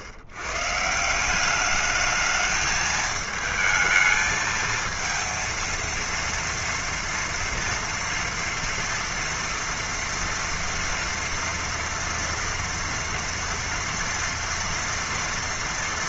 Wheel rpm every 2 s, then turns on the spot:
120, 220, 220, 230, 230, 230, 230, 240.
none